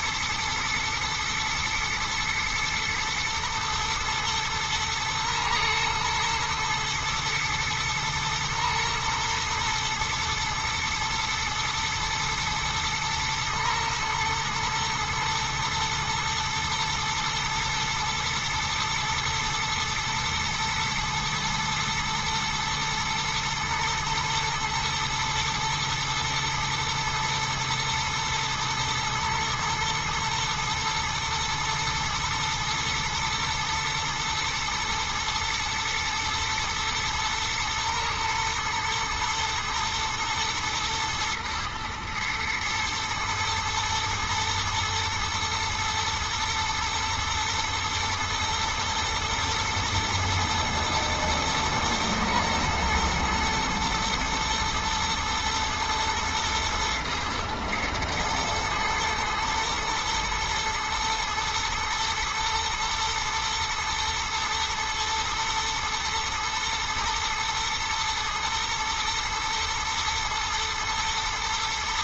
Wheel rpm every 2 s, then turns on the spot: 120, 120, 120, 110, 120, 110, 110, 120, 120, 120, 120, 110, 120, 110, 120, 110, 120, 110, 110, 120, 110, 110, 110, 120, 120, 110, 110, 110, 110, 110, 110, 120, 120, 110, 120, 110.
none